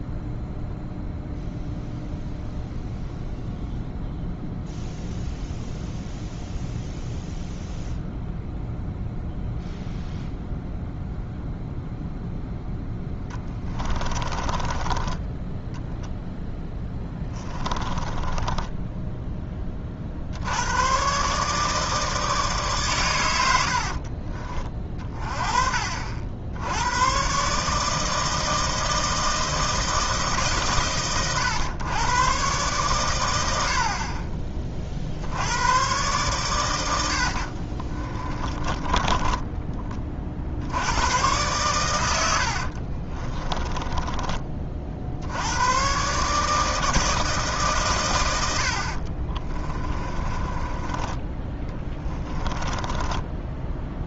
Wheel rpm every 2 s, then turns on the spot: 0, 0, 0, 0, 0, 0, 0, 10, 10, 10, 80, 140, 30, 90, 160, 120, 120, 30, 110, 20, 90, 60, 30, 150, 70, 20, 20.
14-20 38-40 42-44 50-54